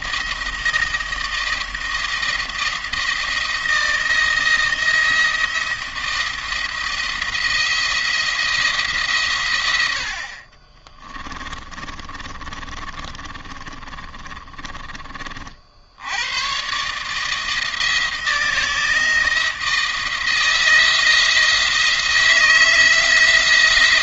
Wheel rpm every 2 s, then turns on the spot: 170, 170, 170, 170, 160, 30, 30, 30, 130, 160, 160, 160.
10-14